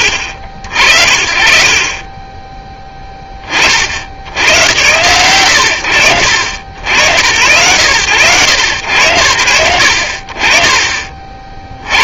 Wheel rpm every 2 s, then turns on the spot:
70, 10, 100, 80, 100, 40.
none